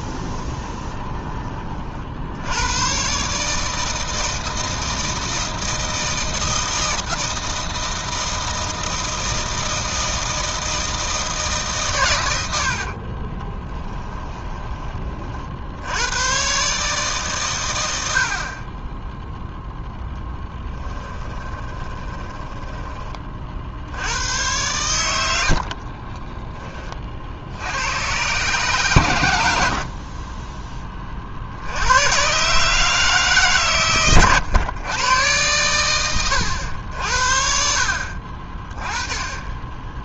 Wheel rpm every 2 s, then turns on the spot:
20, 110, 160, 160, 160, 160, 50, 20, 150, 20, 10, 20, 100, 40, 130, 10, 150, 110, 80, 20.
0-2 12-14 20-22